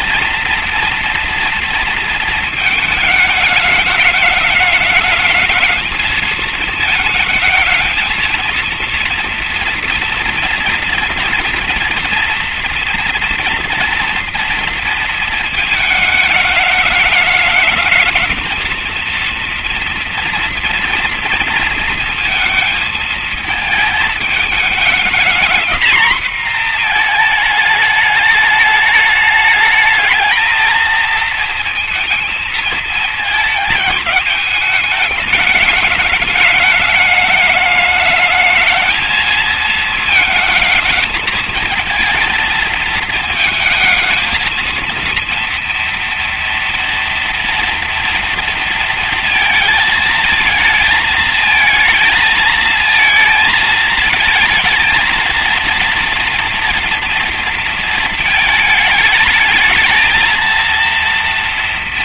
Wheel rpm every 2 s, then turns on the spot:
230, 220, 210, 220, 230, 240, 230, 230, 210, 230, 230, 230, 220, 230, 210, 230, 220, 210, 210, 220, 220, 220, 230, 230, 230, 220, 220, 230, 230, 220, 230.
none